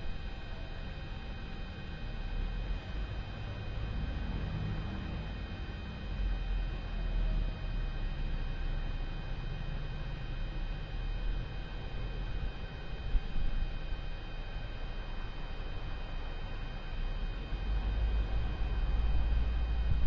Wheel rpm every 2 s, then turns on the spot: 0, 0, 0, 0, 0, 0, 0, 0, 0, 0.
none